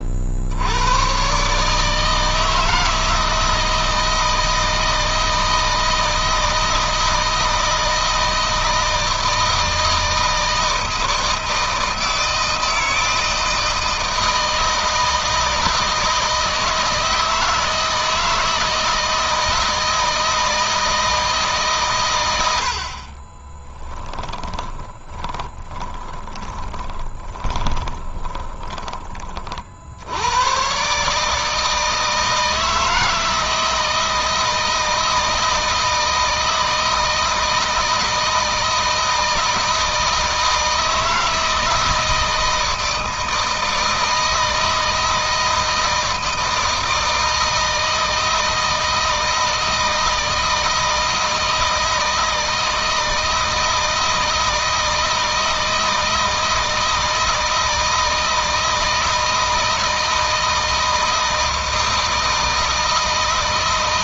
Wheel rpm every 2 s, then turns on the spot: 100, 160, 160, 160, 160, 160, 160, 160, 160, 160, 160, 50, 20, 20, 20, 140, 160, 160, 160, 160, 160, 160, 160, 160, 160, 160, 160, 160, 160, 160, 160, 160.
22-28